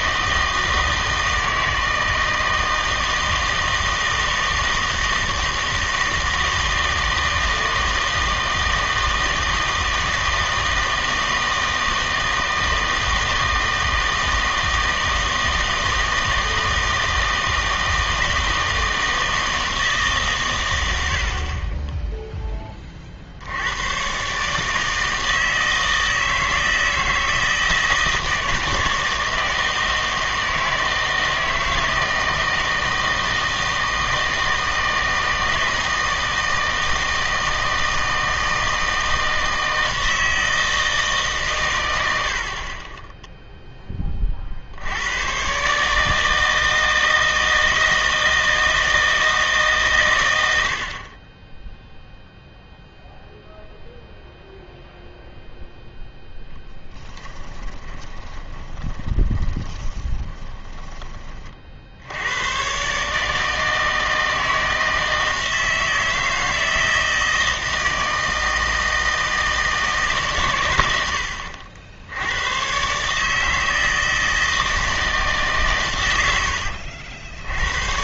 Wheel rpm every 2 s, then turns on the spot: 160, 160, 160, 160, 160, 160, 160, 160, 160, 160, 90, 30, 150, 160, 160, 160, 160, 160, 160, 160, 160, 30, 70, 160, 160, 60, 0, 0, 10, 20, 20, 120, 160, 160, 160, 100, 120, 160, 70.
56-62